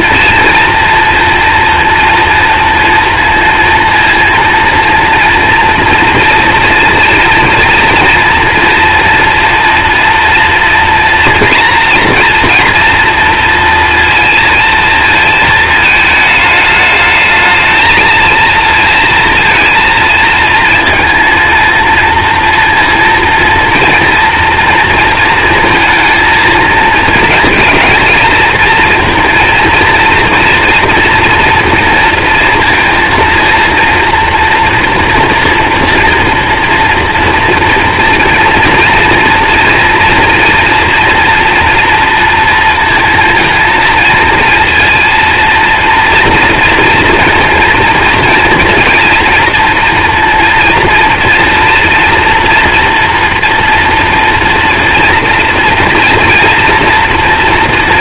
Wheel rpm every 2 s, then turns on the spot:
230, 230, 230, 240, 230, 230, 230, 230, 210, 230, 230, 230, 230, 220, 230, 230, 230, 230, 230, 230, 230, 230, 230, 230, 230, 230, 240, 230, 230.
none